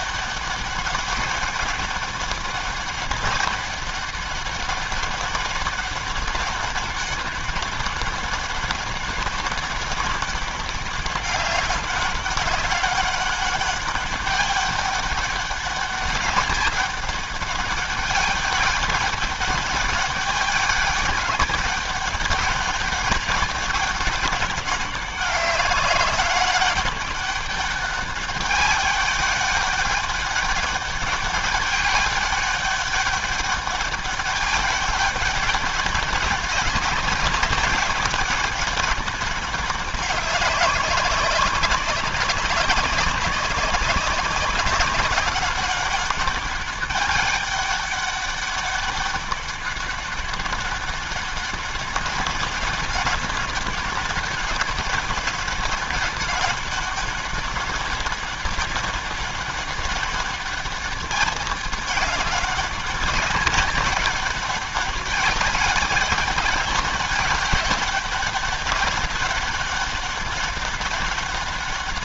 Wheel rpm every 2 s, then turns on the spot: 200, 200, 200, 200, 200, 200, 200, 200, 200, 200, 200, 200, 200, 200, 200, 200, 200, 200, 190, 190, 190, 190, 200, 190, 200, 200, 200, 190, 200, 200, 200, 190, 200, 200, 200, 200.
none